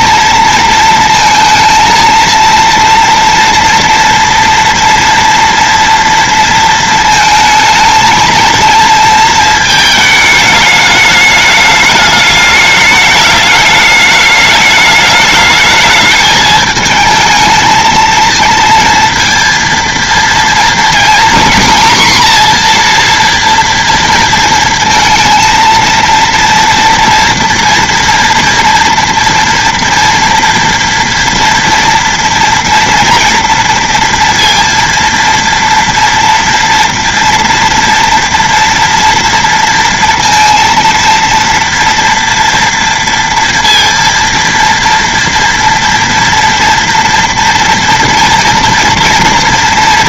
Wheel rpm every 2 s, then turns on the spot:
220, 230, 230, 230, 230, 210, 210, 210, 220, 230, 230, 240, 230, 230, 240, 230, 240, 230, 230, 230, 230, 230, 230, 230, 230.
none